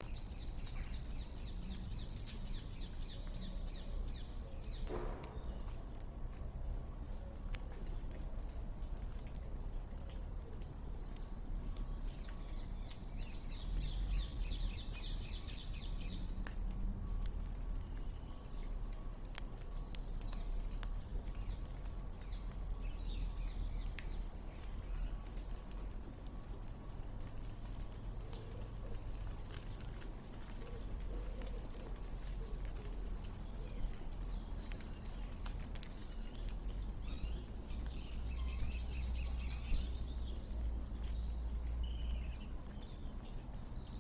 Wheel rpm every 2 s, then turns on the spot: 0, 0, 0, 0, 0, 0, 0, 0, 0, 0, 0, 0, 0, 0, 0, 0, 0, 0, 0, 0, 0, 0.
none